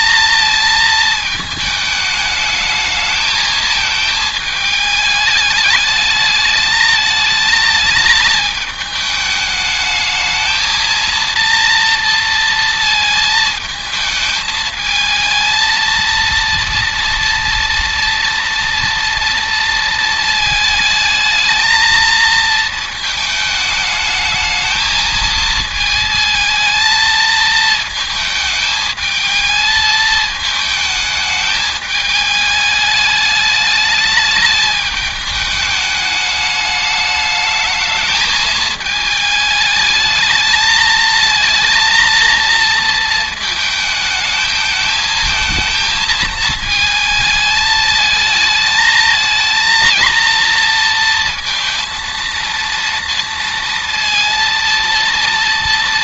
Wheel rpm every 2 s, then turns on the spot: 220, 220, 210, 220, 210, 230, 220, 230, 230, 230, 220, 220, 220, 220, 220, 210, 210, 210, 210, 220, 230, 220, 220, 220, 220, 230, 230, 230.
none